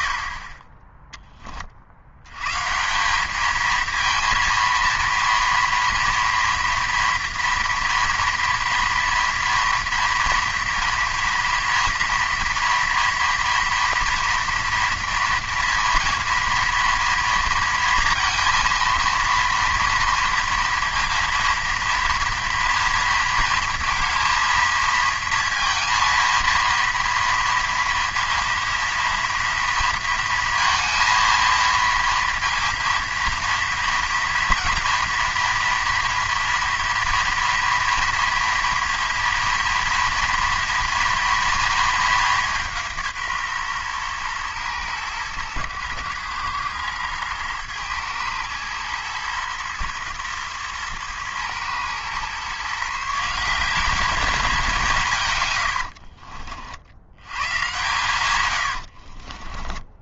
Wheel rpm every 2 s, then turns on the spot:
20, 150, 230, 230, 230, 230, 230, 230, 230, 230, 230, 230, 230, 230, 230, 230, 230, 230, 230, 230, 230, 180, 110, 110, 110, 110, 140, 200, 70, 90.
58-60